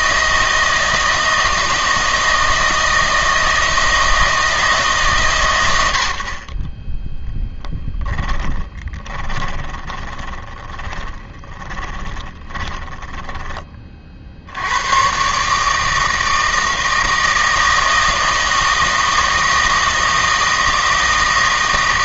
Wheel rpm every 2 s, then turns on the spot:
160, 160, 160, 40, 20, 20, 20, 90, 160, 160, 160.
8-14